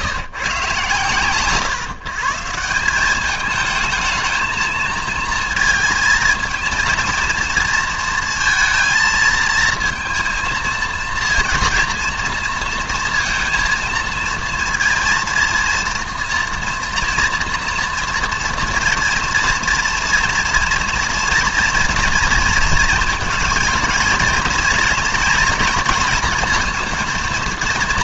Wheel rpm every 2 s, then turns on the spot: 130, 170, 220, 230, 230, 230, 230, 230, 230, 230, 230, 230, 230, 230.
none